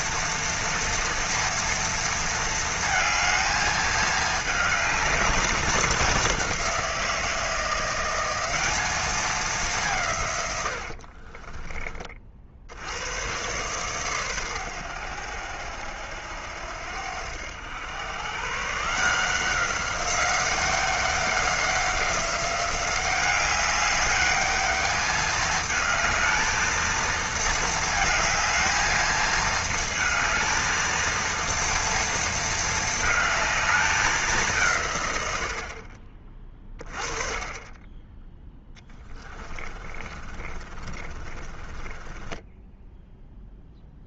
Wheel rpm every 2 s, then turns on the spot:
230, 220, 210, 180, 210, 70, 80, 100, 80, 150, 190, 190, 210, 220, 220, 230, 220, 150, 30, 20, 30, 10.
10-12 38-44